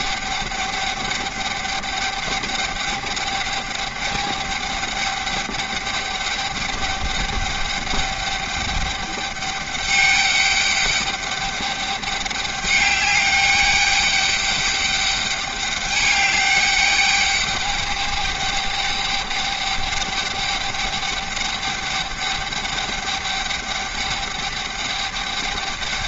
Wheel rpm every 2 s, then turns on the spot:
200, 200, 200, 200, 200, 200, 200, 210, 200, 210, 210, 200, 200.
none